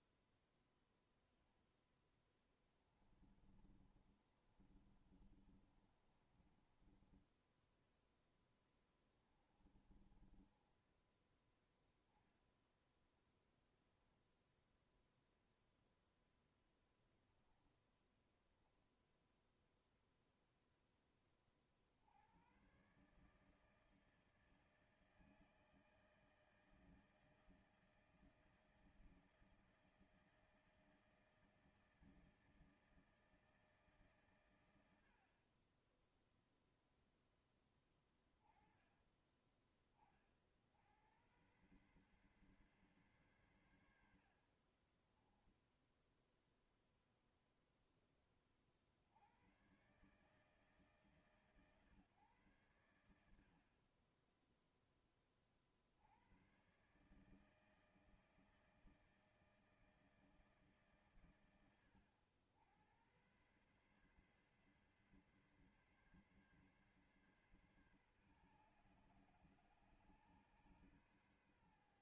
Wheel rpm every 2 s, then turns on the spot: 10, 10, 30, 30, 20, 30, 10, 0, 0, 0, 0, 90, 160, 160, 160, 160, 160, 120, 0, 20, 40, 130, 70, 0, 20, 140, 120, 20, 100, 160, 160, 90, 140, 140, 130, 140.
0-14 44-46